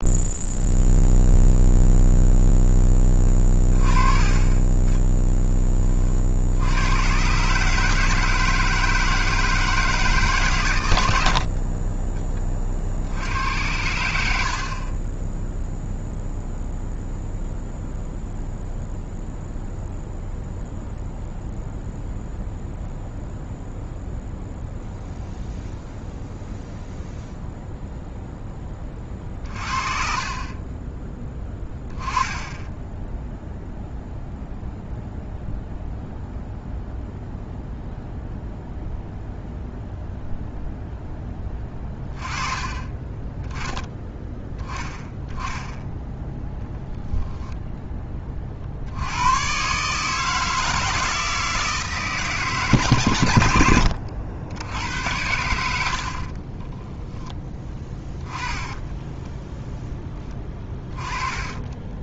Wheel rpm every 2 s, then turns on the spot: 0, 10, 10, 110, 160, 110, 60, 30, 0, 0, 0, 0, 0, 0, 30, 20, 10, 0, 0, 0, 0, 20, 0, 0, 80, 160, 130, 90, 10, 10, 10.
28-32 58-60